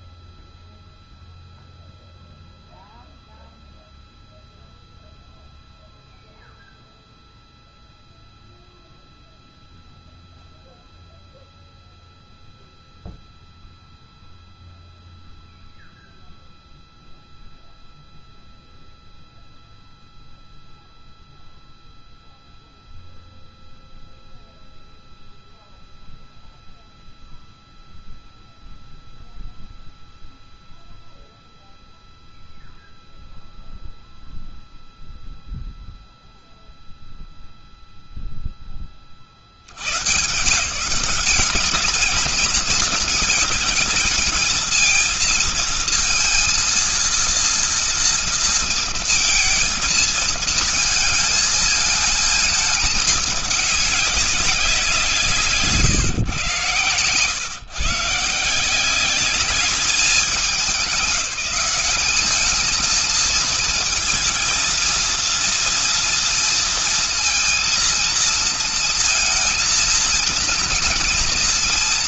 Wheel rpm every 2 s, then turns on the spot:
0, 0, 0, 0, 0, 0, 0, 0, 0, 0, 0, 0, 0, 0, 0, 0, 0, 0, 0, 20, 170, 220, 230, 230, 230, 220, 210, 170, 120, 180, 180, 230, 230, 230, 230, 230.
none